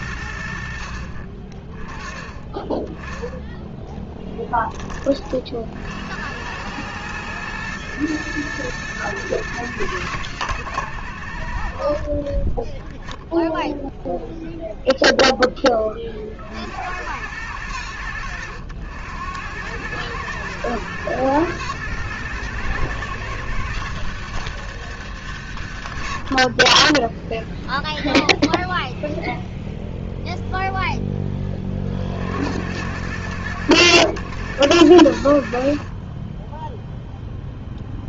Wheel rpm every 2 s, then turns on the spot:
30, 10, 50, 110, 110, 40, 0, 20, 100, 100, 120, 110, 90, 0, 0, 30, 100, 60, 0.
none